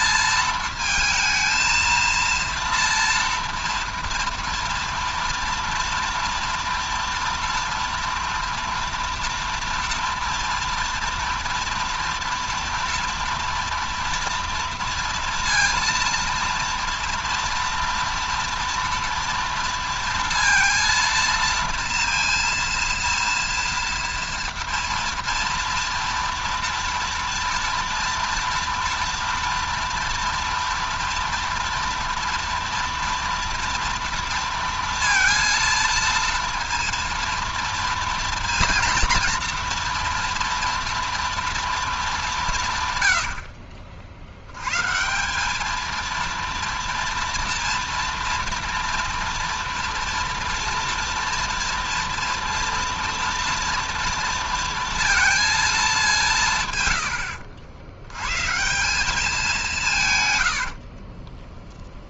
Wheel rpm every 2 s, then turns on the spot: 230, 230, 230, 230, 230, 230, 230, 230, 230, 230, 230, 230, 230, 230, 230, 230, 230, 230, 230, 230, 230, 150, 110, 230, 230, 230, 230, 230, 140, 150, 90.
60-62